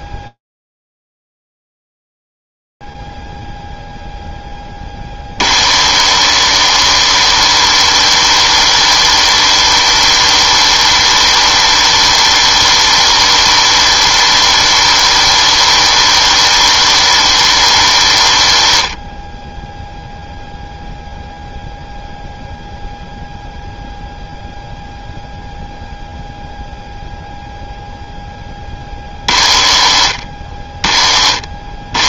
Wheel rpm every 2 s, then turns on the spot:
0, 0, 0, 80, 100, 100, 100, 100, 100, 90, 0, 0, 0, 0, 30, 50.
none